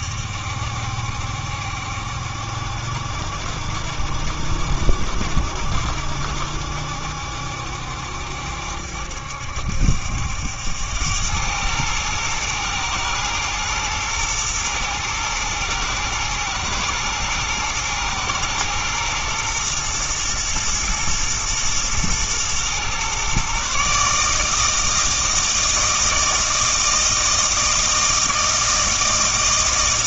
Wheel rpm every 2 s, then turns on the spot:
70, 70, 70, 70, 70, 90, 110, 110, 120, 110, 110, 120, 160, 160, 160.
none